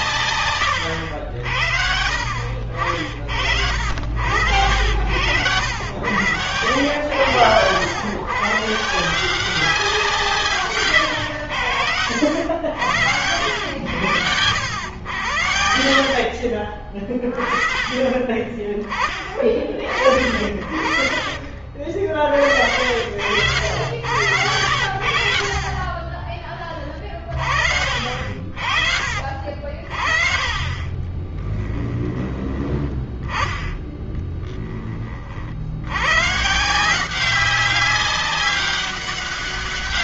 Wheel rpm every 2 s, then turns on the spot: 90, 70, 100, 90, 150, 120, 100, 100, 40, 30, 50, 70, 70, 30, 50, 20, 10, 30, 170, 200.
4-6 16-18 30-32